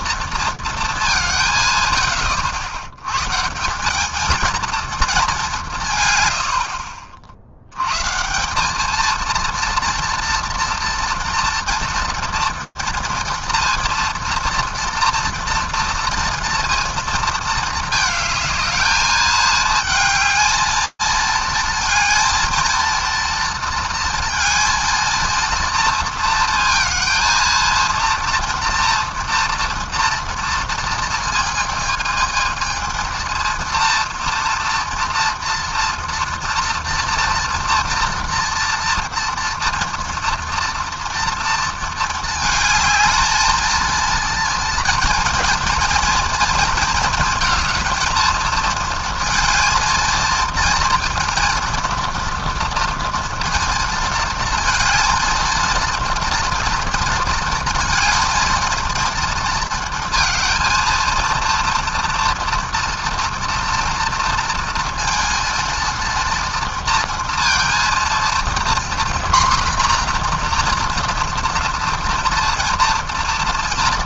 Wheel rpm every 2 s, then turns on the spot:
220, 80, 230, 90, 190, 230, 230, 230, 230, 220, 220, 230, 230, 230, 230, 230, 220, 230, 230, 230, 230, 220, 230, 230, 230, 230, 230, 220, 230, 230, 220, 240, 230, 230, 230, 240, 230.
none